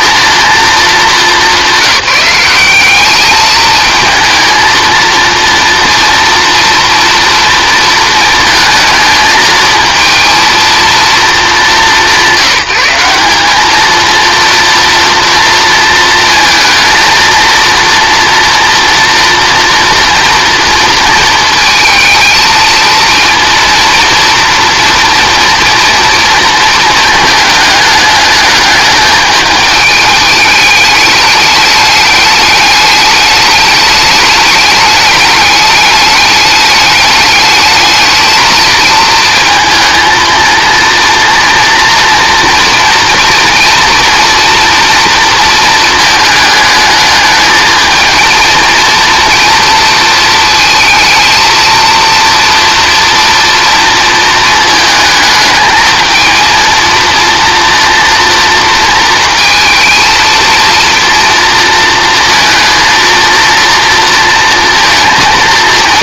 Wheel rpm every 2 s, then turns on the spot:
230, 190, 230, 230, 220, 230, 190, 230, 230, 230, 230, 220, 230, 220, 210, 210, 210, 210, 210, 220, 230, 230, 230, 220, 230, 220, 230, 220, 230, 230, 230, 230, 230.
none